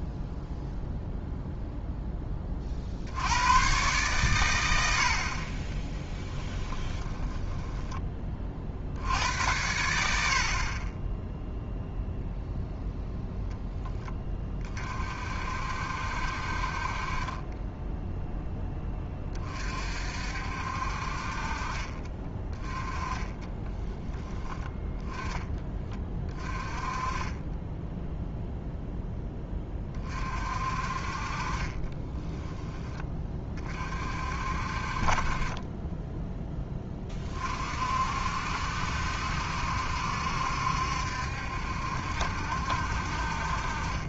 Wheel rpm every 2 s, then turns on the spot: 0, 50, 90, 10, 50, 40, 0, 30, 50, 10, 60, 20, 10, 20, 0, 50, 10, 50, 10, 60, 70, 60.
6-8